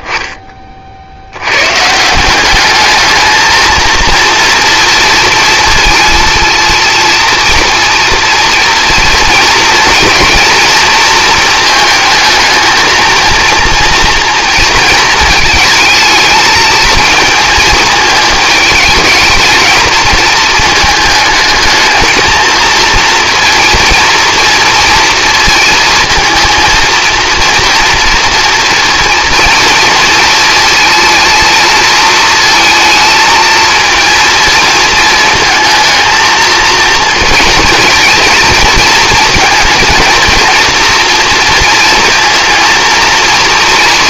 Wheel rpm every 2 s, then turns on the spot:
20, 190, 230, 230, 230, 230, 220, 230, 220, 220, 220, 230, 230, 230, 230, 230, 230, 230, 220, 230, 240, 230.
none